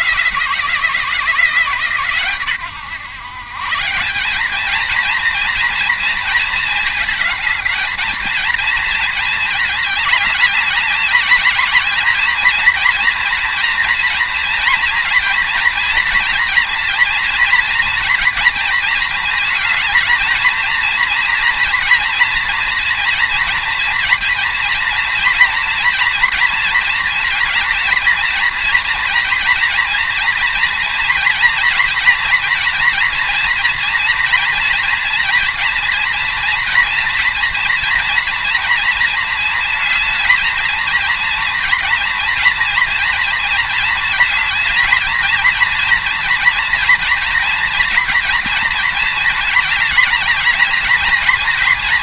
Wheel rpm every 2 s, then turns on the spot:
170, 120, 220, 220, 230, 200, 230, 230, 230, 220, 230, 240, 230, 230, 230, 230, 230, 230, 230, 230, 230, 230, 220, 230, 220, 220.
none